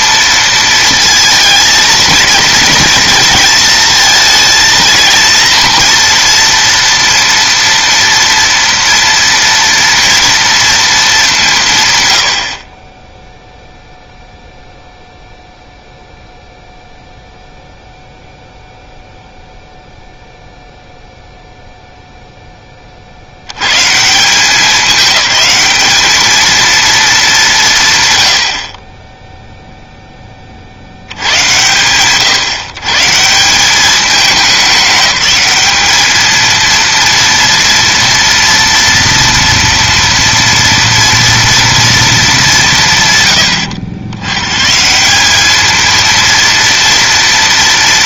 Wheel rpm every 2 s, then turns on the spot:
230, 230, 220, 230, 230, 230, 20, 0, 0, 0, 0, 30, 200, 230, 50, 60, 140, 200, 230, 230, 230, 170, 130, 230.
none